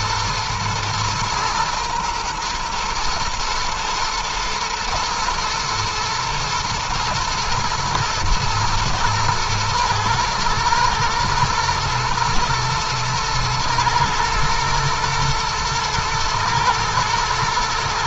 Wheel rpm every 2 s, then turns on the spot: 110, 110, 110, 110, 110, 120, 110, 120, 110.
none